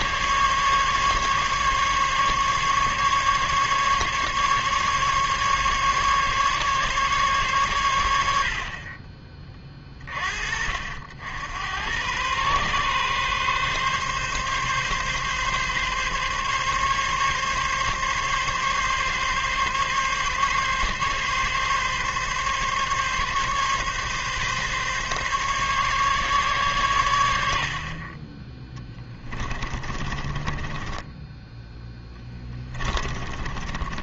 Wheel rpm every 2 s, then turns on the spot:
140, 140, 140, 140, 40, 60, 130, 140, 140, 140, 140, 140, 140, 120, 10, 20, 20.
28-34